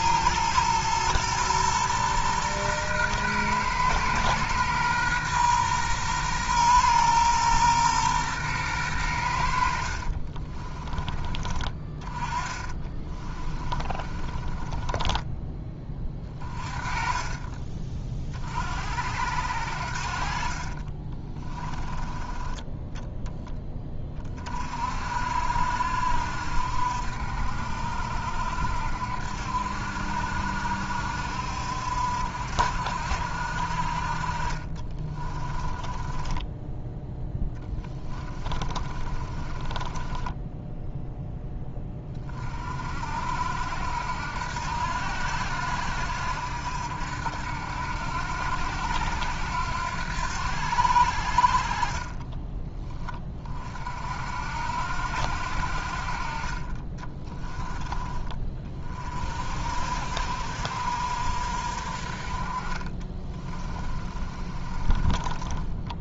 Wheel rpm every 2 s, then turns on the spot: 120, 120, 120, 120, 110, 20, 20, 20, 30, 50, 30, 10, 40, 60, 60, 60, 60, 30, 10, 30, 10, 40, 80, 70, 80, 80, 10, 70, 30, 30, 60, 30, 30.
10-16 20-22 34-42 56-58 62-66